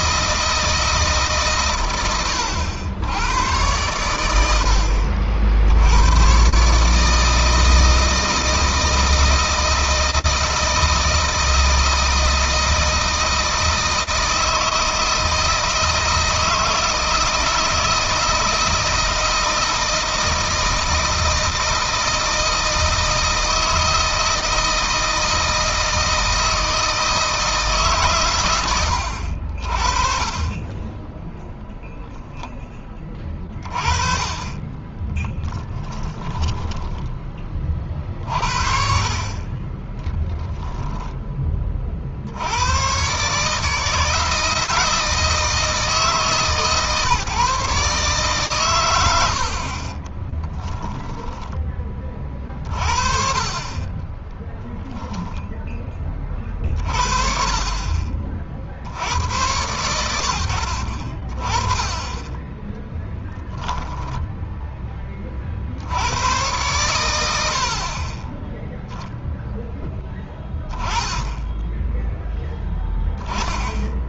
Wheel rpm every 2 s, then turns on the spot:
160, 90, 70, 140, 160, 160, 160, 160, 160, 160, 160, 160, 160, 160, 100, 20, 20, 20, 10, 60, 10, 120, 160, 150, 100, 10, 30, 0, 50, 70, 60, 10, 10, 110, 0, 20, 10.
34-40 48-52 62-64